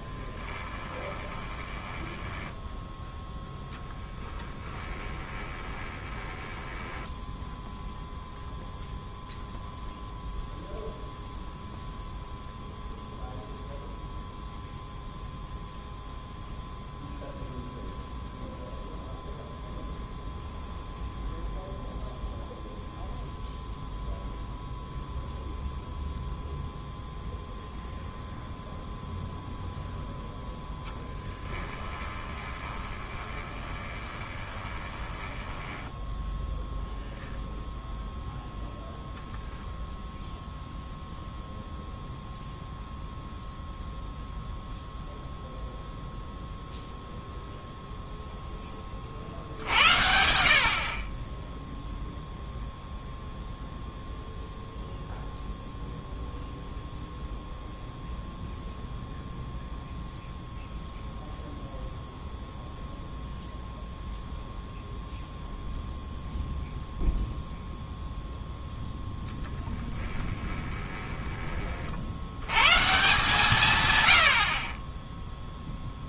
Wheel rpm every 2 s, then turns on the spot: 20, 10, 10, 10, 0, 0, 0, 0, 0, 0, 0, 0, 0, 0, 0, 0, 20, 20, 0, 0, 0, 0, 0, 0, 10, 60, 0, 0, 0, 0, 0, 0, 0, 0, 0, 20, 110, 50.
0-8 32-36 70-72